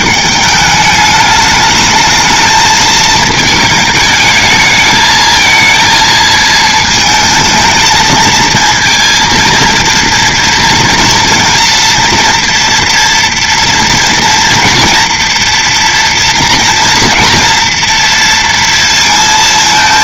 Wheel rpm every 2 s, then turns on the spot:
200, 220, 220, 220, 230, 230, 230, 230, 230, 230.
none